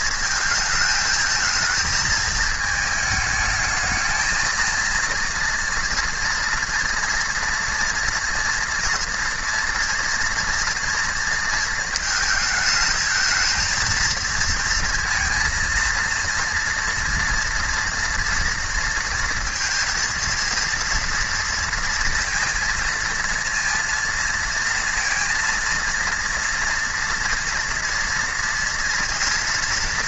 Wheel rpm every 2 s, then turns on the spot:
220, 220, 230, 230, 230, 230, 220, 230, 230, 230, 230, 230, 230, 230, 230.
none